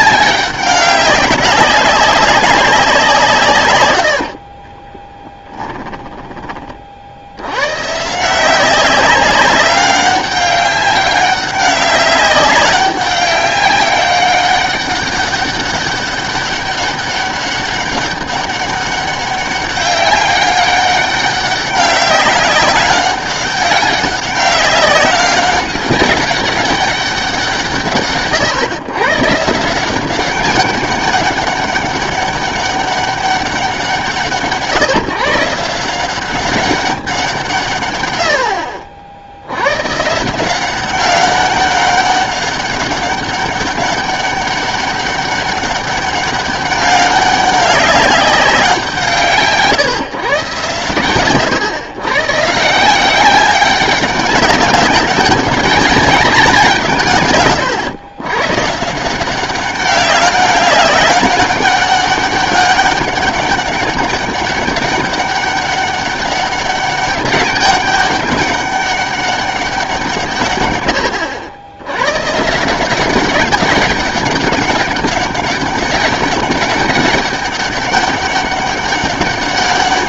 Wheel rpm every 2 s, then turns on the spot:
190, 180, 30, 40, 190, 200, 200, 200, 200, 200, 200, 200, 190, 200, 120, 200, 200, 160, 190, 60, 190, 200, 200, 200, 180, 120, 160, 200, 160, 140, 200, 200, 200, 200, 200, 110, 170, 190, 200, 200.
4-6